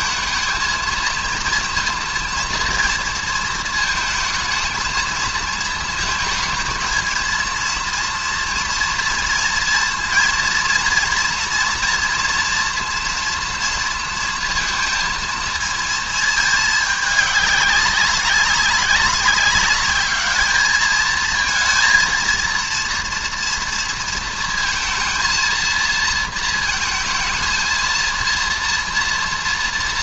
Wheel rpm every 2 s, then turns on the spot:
220, 230, 220, 230, 230, 230, 240, 230, 220, 190, 210, 230, 230, 230, 230.
none